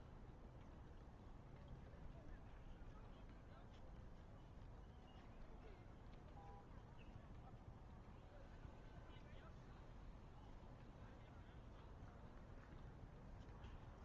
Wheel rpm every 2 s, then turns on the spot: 0, 0, 0, 0, 0, 0, 0.
none